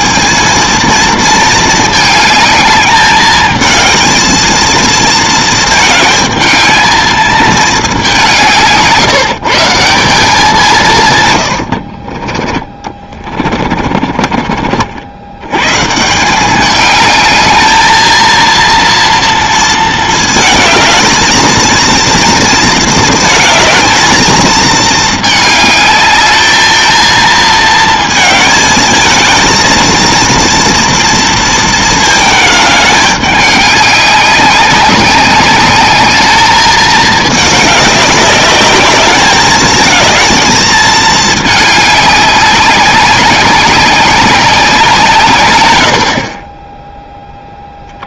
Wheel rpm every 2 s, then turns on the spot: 220, 210, 220, 220, 160, 170, 20, 50, 190, 230, 220, 230, 220, 220, 220, 230, 210, 190, 210, 200, 220, 200, 190, 20.
12-14